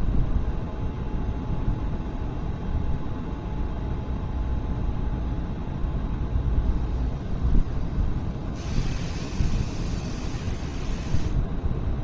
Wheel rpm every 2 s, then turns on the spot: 80, 0, 0, 0, 20, 0.
none